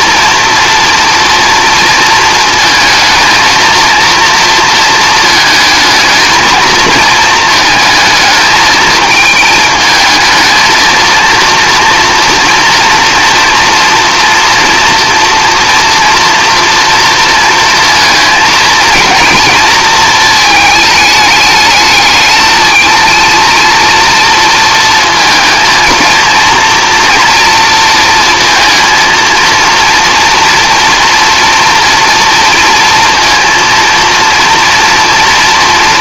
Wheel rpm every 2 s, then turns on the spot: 230, 230, 230, 230, 220, 220, 230, 230, 230, 220, 220, 220, 230, 240, 230, 230, 230, 230.
none